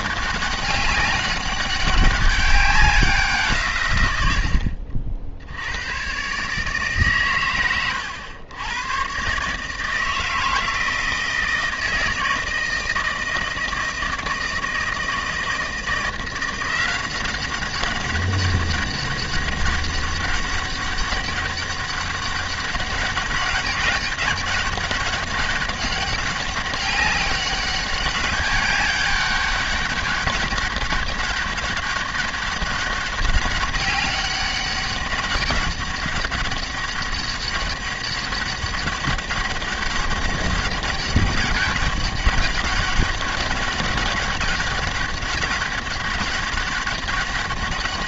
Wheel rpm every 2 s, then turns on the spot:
200, 190, 80, 140, 110, 160, 160, 160, 180, 200, 200, 200, 200, 200, 200, 200, 200, 200, 200, 200, 200, 200, 200, 200.
none